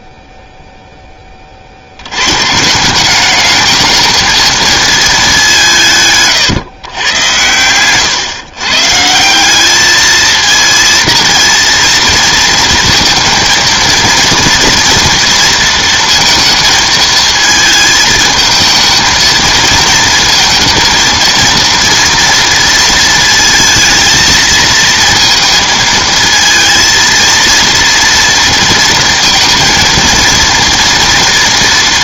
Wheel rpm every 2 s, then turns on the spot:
30, 210, 190, 110, 190, 230, 230, 230, 220, 220, 230, 230, 220, 230, 230, 230.
none